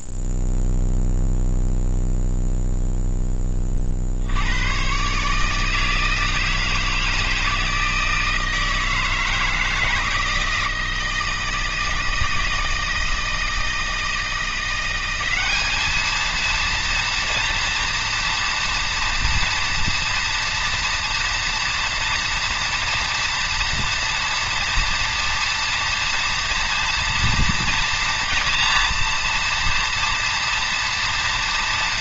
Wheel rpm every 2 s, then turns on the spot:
0, 0, 80, 160, 160, 160, 160, 160, 220, 230, 230, 230, 230, 230, 230, 230.
none